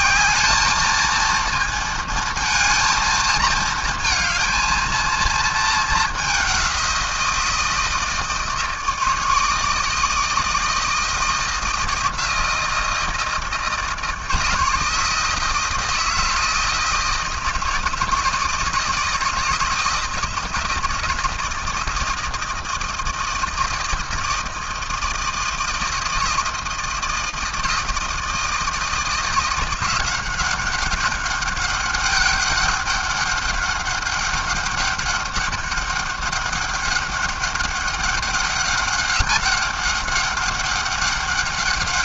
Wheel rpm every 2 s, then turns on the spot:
180, 230, 220, 210, 160, 160, 160, 160, 160, 160, 160, 160, 160, 160, 160, 180, 200, 190, 200, 200, 200.
none